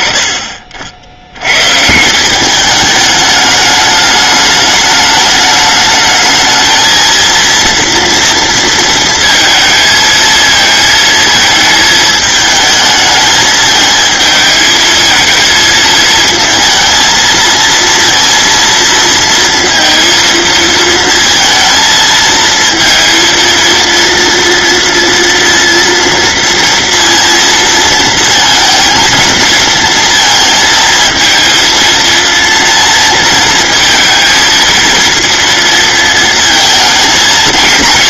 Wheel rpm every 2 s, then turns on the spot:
40, 210, 210, 230, 230, 230, 220, 220, 230, 230, 230, 230, 230, 230, 220, 220, 230, 230, 220.
none